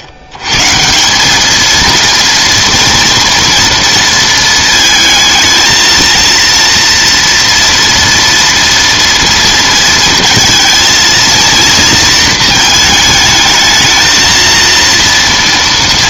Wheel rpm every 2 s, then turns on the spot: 130, 230, 220, 230, 230, 220, 220, 230.
none